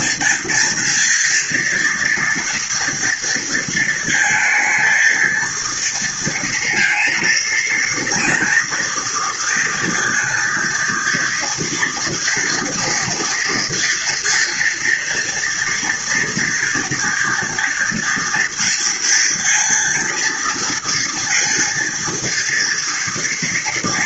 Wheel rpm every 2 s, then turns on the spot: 230, 230, 220, 230, 230, 230, 230, 230, 230, 230, 230, 230.
none